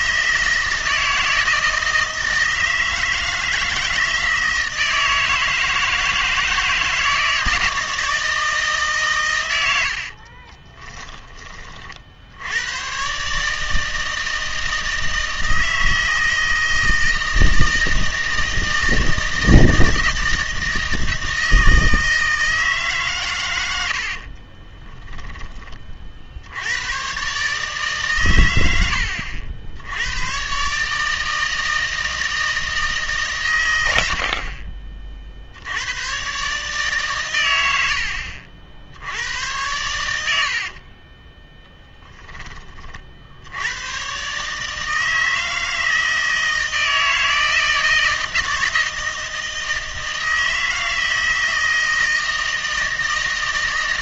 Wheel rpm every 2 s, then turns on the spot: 160, 160, 160, 160, 150, 20, 100, 160, 160, 160, 160, 150, 20, 90, 90, 140, 160, 40, 140, 60, 40, 20, 150, 160, 160, 160, 160.
10-12 24-26 40-42